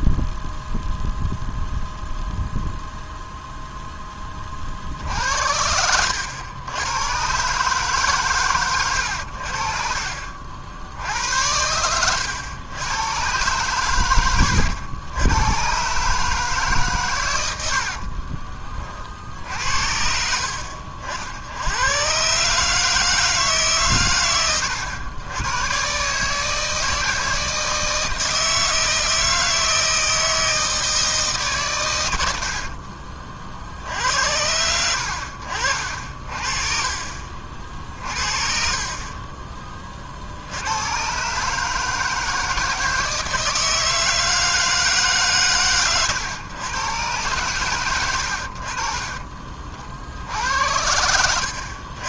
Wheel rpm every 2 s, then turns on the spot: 0, 0, 60, 110, 100, 70, 100, 90, 130, 30, 60, 150, 100, 160, 160, 160, 50, 80, 40, 40, 100, 160, 160, 120, 40, 80.
32-34